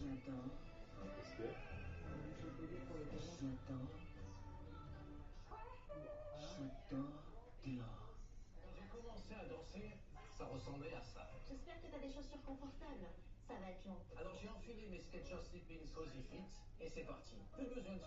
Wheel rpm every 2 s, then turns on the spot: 0, 0, 0, 0, 0, 0, 0, 0, 0.
none